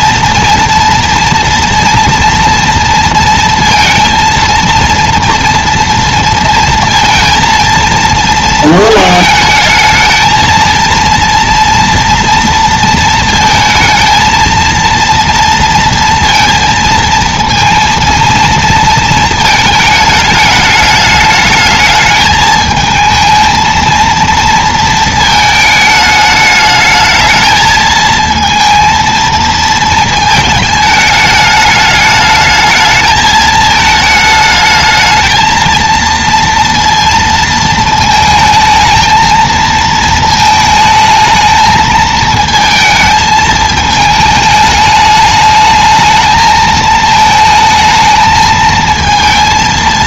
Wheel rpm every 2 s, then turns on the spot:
230, 230, 230, 230, 230, 230, 230, 230, 230, 230, 210, 220, 230, 210, 230, 210, 220, 220, 230, 220, 220, 220, 210, 220, 220.
none